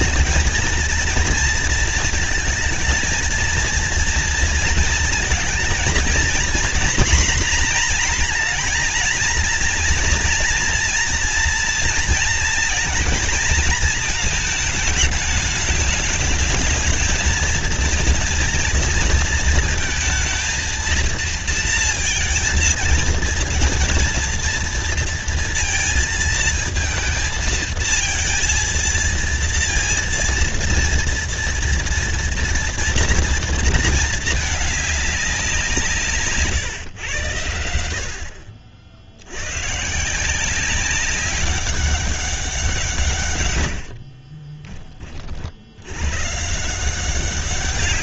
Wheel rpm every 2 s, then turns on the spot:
230, 220, 230, 230, 240, 230, 220, 220, 220, 230, 230, 220, 230, 230, 230, 230, 230, 220, 140, 70, 190, 180, 20, 160.
44-46